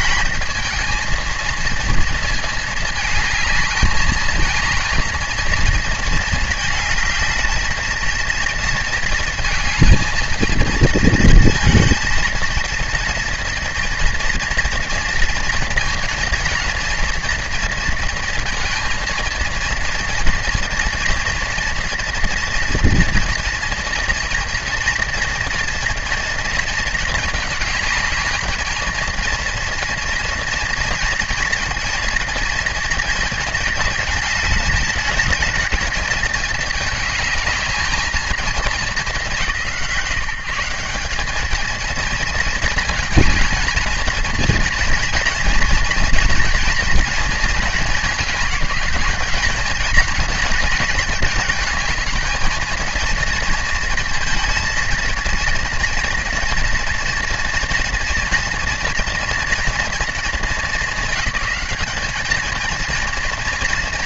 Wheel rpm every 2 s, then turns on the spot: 230, 220, 220, 220, 230, 220, 230, 230, 230, 230, 240, 240, 240, 230, 220, 230, 230, 220, 220, 210, 180, 230, 230, 230, 220, 230, 220, 220, 230, 230, 210, 230.
none